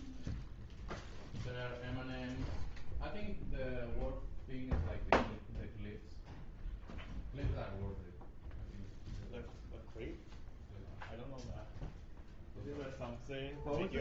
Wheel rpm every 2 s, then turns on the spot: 0, 0, 0, 0, 0, 0, 0.
none